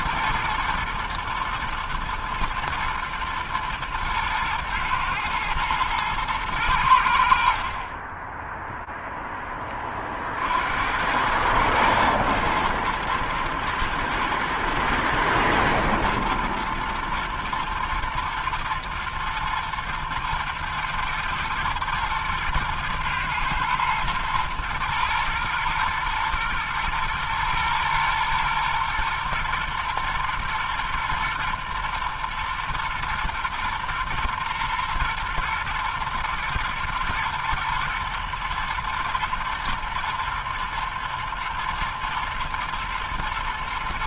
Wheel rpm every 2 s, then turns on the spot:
120, 110, 110, 110, 10, 60, 110, 110, 120, 110, 120, 110, 110, 120, 120, 120, 120, 120, 110, 120, 120, 120.
none